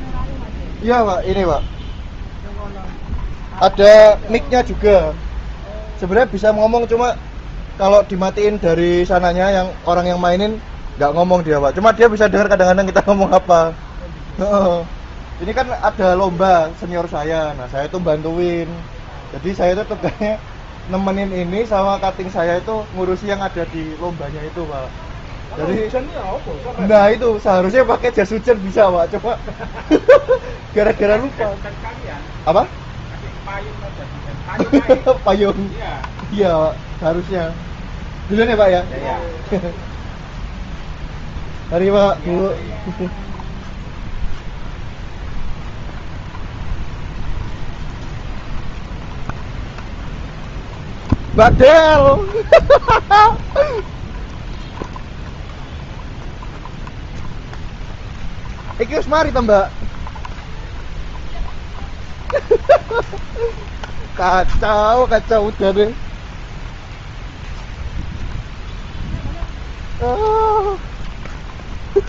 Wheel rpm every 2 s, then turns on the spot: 0, 0, 0, 0, 0, 0, 0, 0, 0, 0, 0, 0, 0, 0, 0, 0, 0, 0, 0, 0, 0, 0, 0, 0, 0, 0, 0, 0, 0, 0, 0, 0, 0, 0, 0, 0.
none